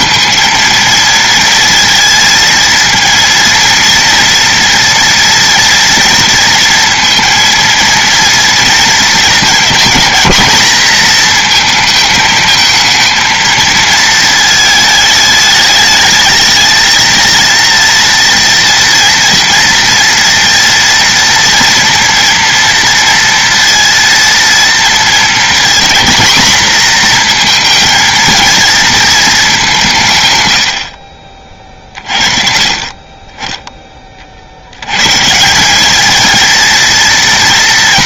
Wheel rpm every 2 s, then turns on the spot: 230, 230, 230, 230, 230, 220, 220, 220, 220, 230, 230, 230, 230, 230, 220, 70, 30, 100, 230.
none